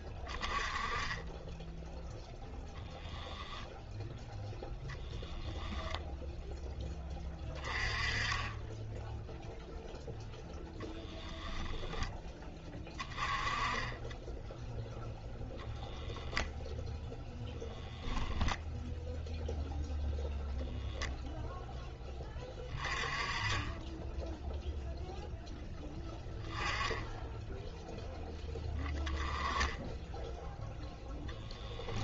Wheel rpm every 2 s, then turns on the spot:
20, 0, 10, 10, 10, 0, 20, 0, 0, 0, 0, 20, 0, 10, 10, 10.
4-6 28-30